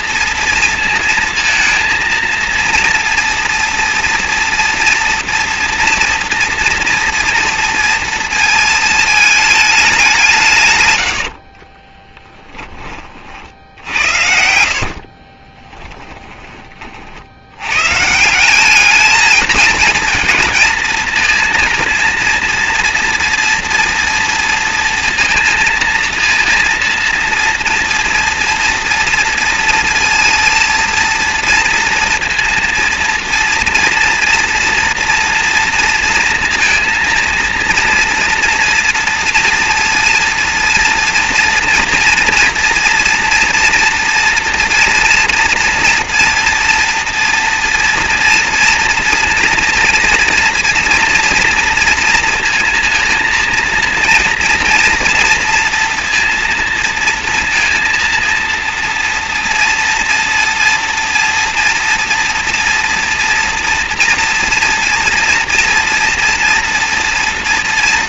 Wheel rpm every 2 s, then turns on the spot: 230, 230, 230, 230, 220, 130, 20, 60, 30, 200, 230, 230, 230, 230, 230, 230, 230, 230, 230, 230, 230, 230, 230, 230, 230, 230, 230, 230, 230, 230, 230, 230, 230, 240.
10-12 14-16